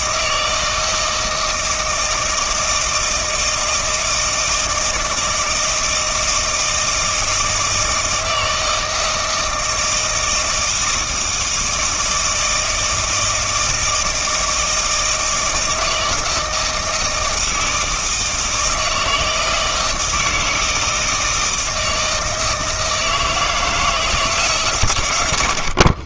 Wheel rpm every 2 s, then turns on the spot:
160, 160, 160, 160, 160, 160, 160, 160, 160, 160, 160, 160, 140.
none